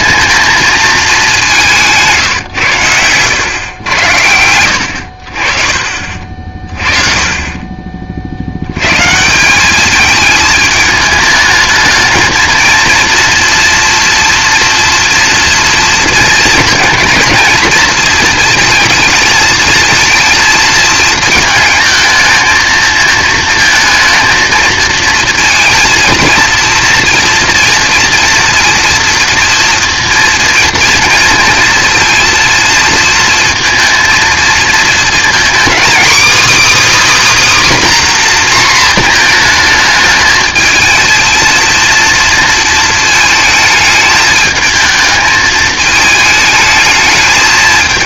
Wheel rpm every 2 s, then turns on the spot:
220, 120, 100, 40, 90, 220, 230, 230, 220, 230, 220, 220, 220, 230, 230, 230, 230, 230, 300, 240, 220, 230, 220, 220.
4-6